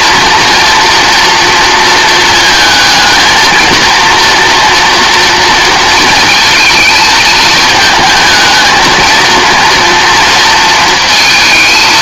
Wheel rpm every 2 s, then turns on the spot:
240, 230, 240, 230, 220, 230.
none